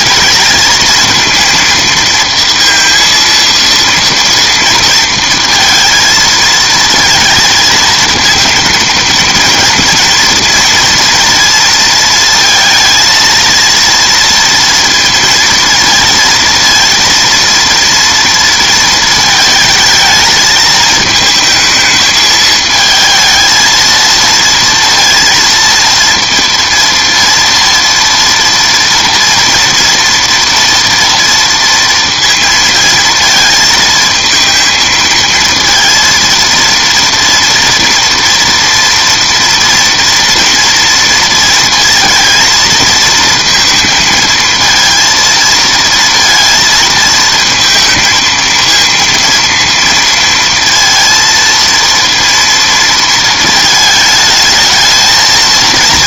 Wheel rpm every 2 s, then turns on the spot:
230, 230, 230, 230, 230, 230, 230, 230, 230, 230, 220, 220, 230, 230, 230, 230, 230, 220, 230, 230, 230, 230, 230, 230, 230, 230, 230, 220.
none